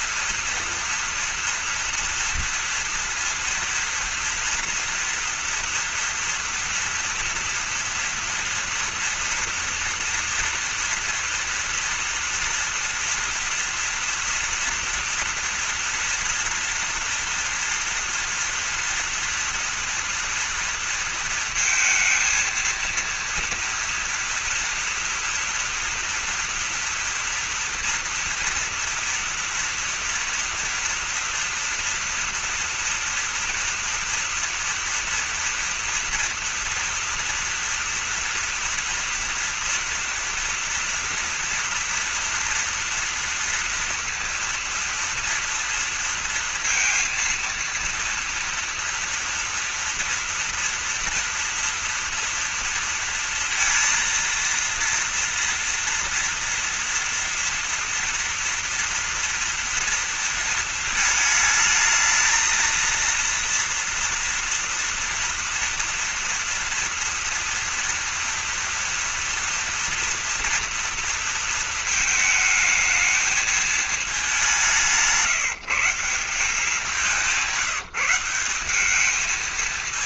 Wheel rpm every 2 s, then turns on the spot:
230, 230, 240, 230, 230, 230, 230, 240, 230, 230, 230, 230, 230, 230, 230, 230, 230, 230, 240, 230, 230, 240, 230, 230, 240, 240, 230, 230, 230, 230, 230, 230, 240, 230, 230, 230, 220, 190, 180, 190.
none